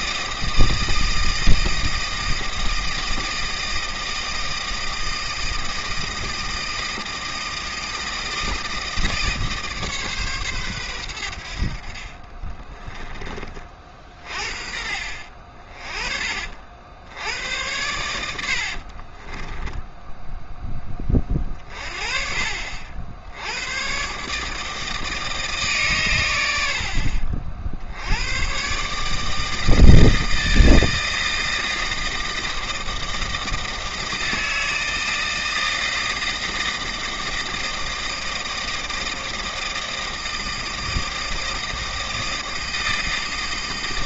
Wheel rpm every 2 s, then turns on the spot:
160, 160, 160, 160, 160, 100, 20, 50, 80, 40, 20, 70, 160, 60, 150, 160, 160, 160, 160, 160, 160, 160.
12-14 18-20